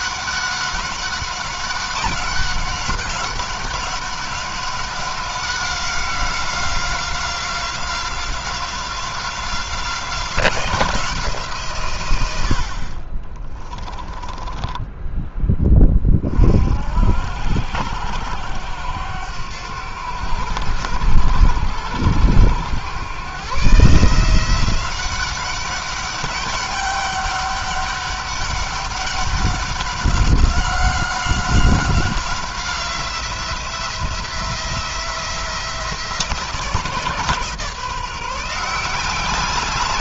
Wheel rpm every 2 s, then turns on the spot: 190, 190, 190, 180, 180, 180, 50, 10, 60, 90, 90, 110, 180, 200, 200, 190, 180, 170, 160, 180.
12-16